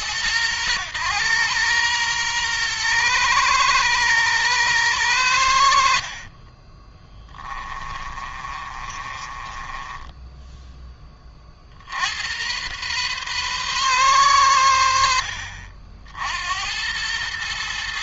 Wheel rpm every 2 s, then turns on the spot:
110, 120, 110, 20, 30, 10, 120, 80, 90.
6-10